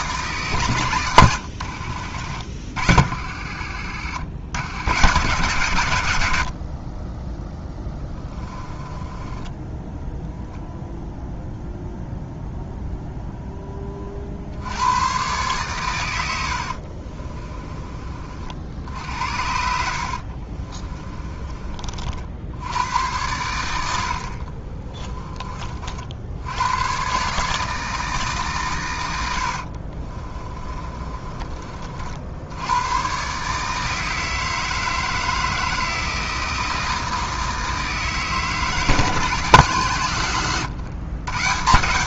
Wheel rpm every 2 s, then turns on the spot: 120, 60, 110, 50, 20, 0, 0, 90, 50, 70, 30, 90, 40, 110, 120, 30, 110, 160, 160, 150, 120.
8-10 16-18 20-22 24-26 30-32